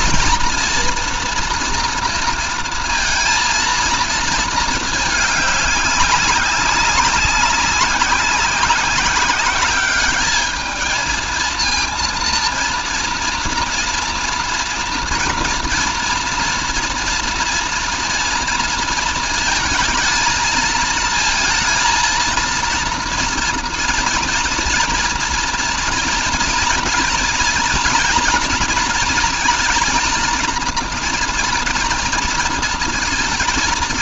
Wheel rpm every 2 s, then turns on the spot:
230, 230, 210, 190, 190, 220, 230, 230, 240, 230, 220, 230, 230, 230, 230, 230, 230.
none